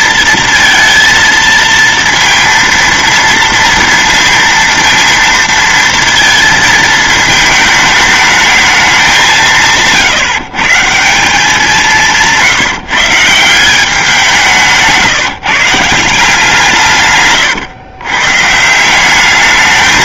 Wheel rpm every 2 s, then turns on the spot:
230, 230, 230, 230, 220, 150, 170, 170, 170, 140.
none